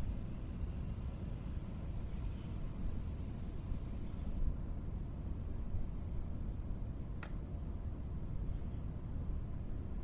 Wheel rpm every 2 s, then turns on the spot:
0, 0, 0, 0, 0.
none